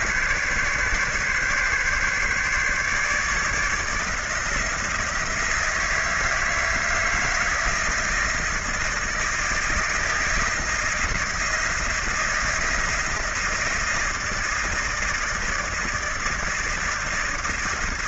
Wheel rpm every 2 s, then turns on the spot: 140, 150, 160, 160, 160, 160, 170, 160, 160.
none